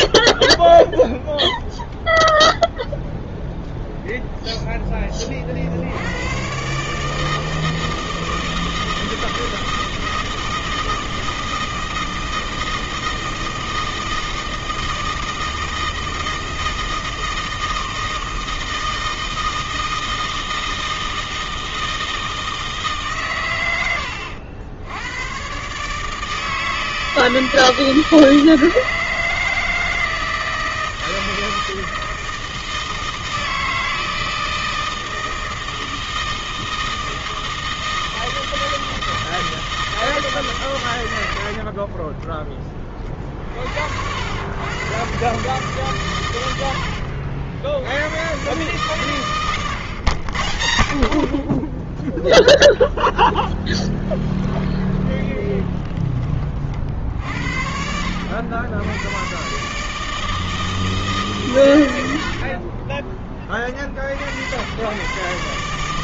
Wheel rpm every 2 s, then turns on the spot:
0, 0, 10, 150, 160, 160, 160, 160, 160, 160, 160, 140, 100, 160, 160, 160, 160, 160, 160, 160, 90, 40, 120, 60, 130, 60, 0, 20, 60, 100, 150, 30, 120.
46-48 54-56